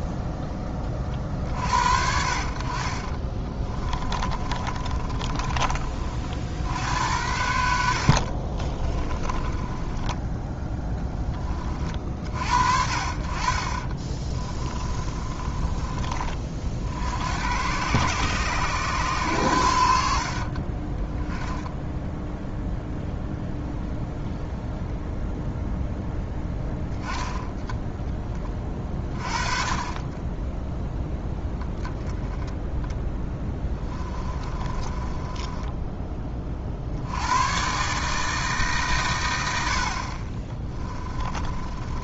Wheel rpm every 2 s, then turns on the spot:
30, 40, 30, 70, 30, 10, 60, 30, 50, 120, 20, 0, 0, 0, 20, 10, 10, 30, 50, 150, 20.
4-6 8-10 14-16 28-30 34-36 40-42